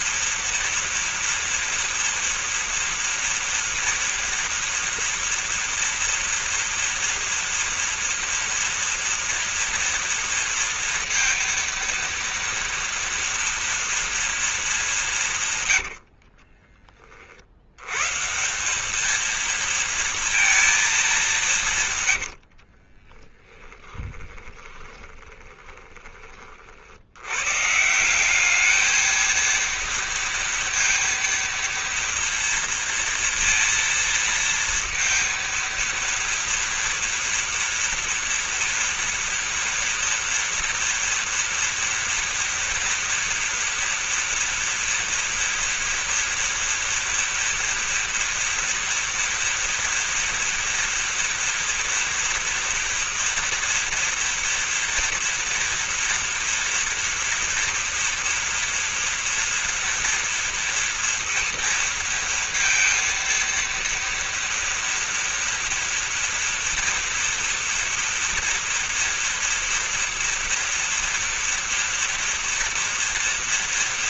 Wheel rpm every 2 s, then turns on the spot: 230, 240, 230, 230, 230, 230, 230, 210, 30, 210, 220, 50, 20, 70, 220, 230, 230, 230, 230, 230, 230, 230, 230, 230, 230, 230, 230, 230, 230, 240, 230, 230, 230, 230, 230, 230, 240.
22-26